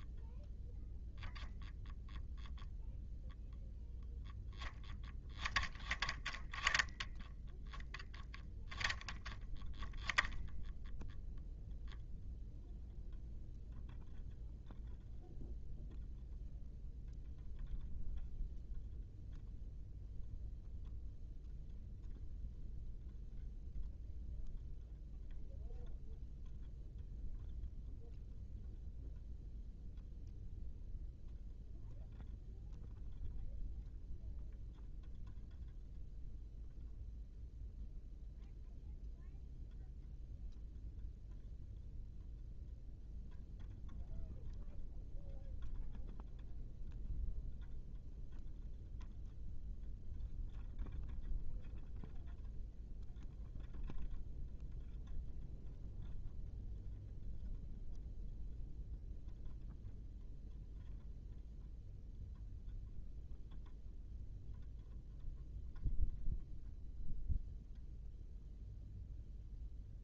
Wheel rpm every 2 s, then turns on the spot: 0, 0, 0, 0, 10, 0, 0, 0, 0, 0, 0, 0, 0, 0, 0, 0, 0, 0, 0, 0, 0, 0, 0, 0, 0, 0, 0, 0, 0, 0, 0, 0, 0, 0, 0.
none